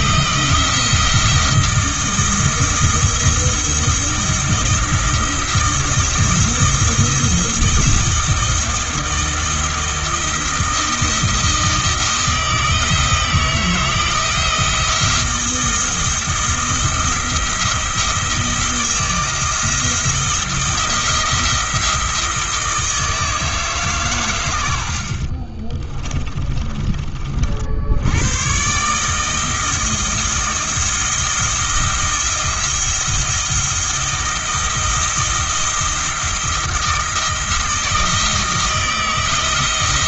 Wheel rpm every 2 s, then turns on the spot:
170, 160, 170, 170, 170, 160, 160, 170, 170, 170, 170, 160, 80, 30, 140, 170, 170, 160, 170, 160.
26-28